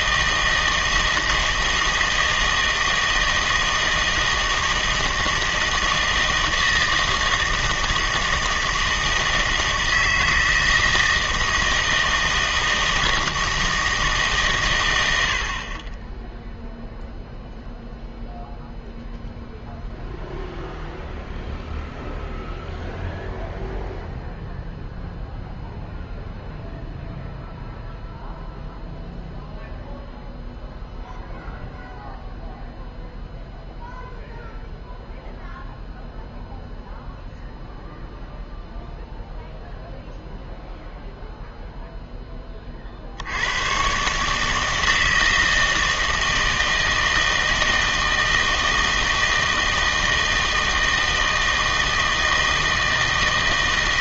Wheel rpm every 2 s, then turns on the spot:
160, 160, 160, 160, 160, 160, 160, 120, 0, 0, 0, 0, 0, 0, 0, 0, 0, 0, 0, 0, 0, 40, 160, 160, 160, 160, 160.
none